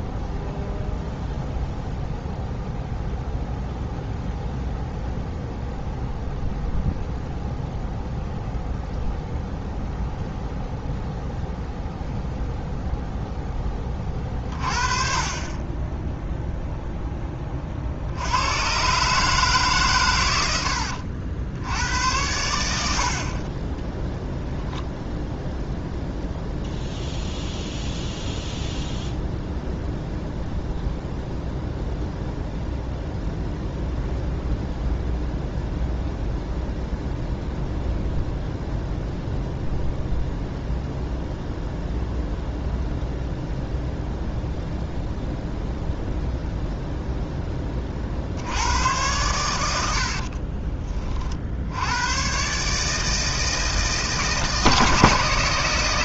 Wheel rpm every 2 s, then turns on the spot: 0, 0, 0, 0, 0, 0, 0, 40, 0, 120, 80, 70, 0, 0, 0, 0, 0, 0, 0, 0, 0, 0, 0, 0, 90, 30, 150, 160.
20-22